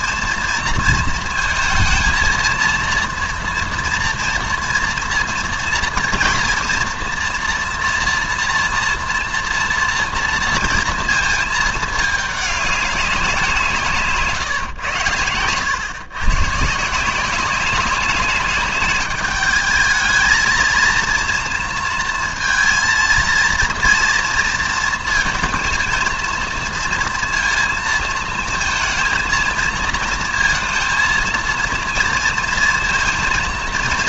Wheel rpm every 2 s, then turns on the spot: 230, 230, 240, 230, 240, 230, 200, 120, 140, 200, 220, 230, 230, 230, 220, 230, 230.
none